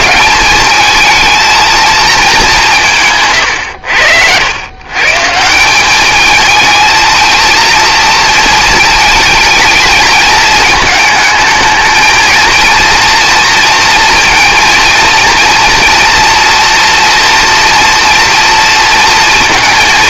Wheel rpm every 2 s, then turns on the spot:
220, 140, 150, 220, 220, 220, 230, 230, 230, 230.
2-4